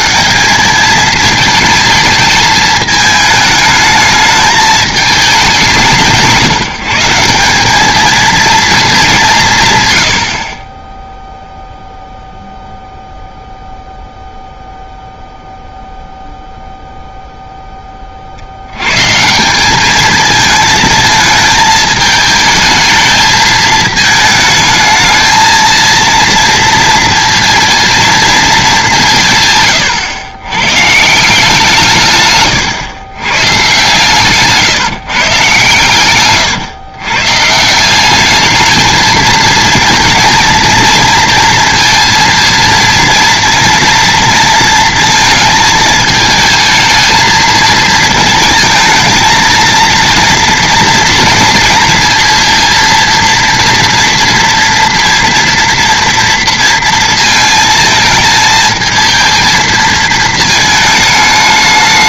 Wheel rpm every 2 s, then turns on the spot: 210, 220, 220, 180, 220, 40, 0, 0, 0, 90, 220, 220, 210, 230, 210, 110, 120, 140, 130, 210, 230, 230, 230, 220, 230, 230, 230, 230, 230, 220, 220.
none